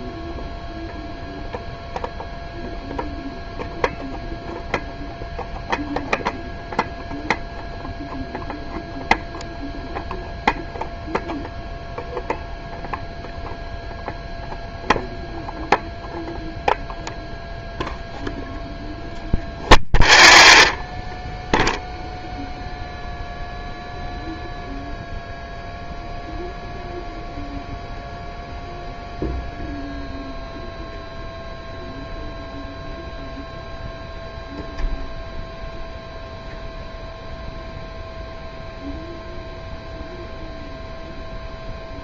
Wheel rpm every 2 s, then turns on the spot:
0, 0, 0, 0, 0, 0, 0, 0, 0, 0, 0, 0, 0, 0, 0, 0, 0, 0, 0, 0, 0.
none